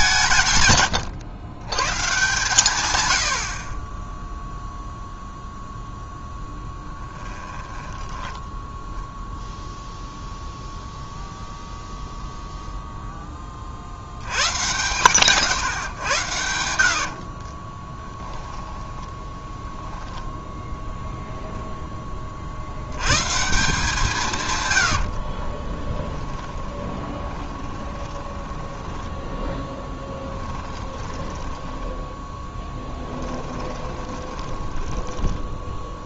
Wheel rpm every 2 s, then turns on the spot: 130, 130, 0, 10, 0, 0, 0, 100, 70, 10, 10, 60, 120, 20, 10, 20, 10, 20.
6-8 16-20 26-36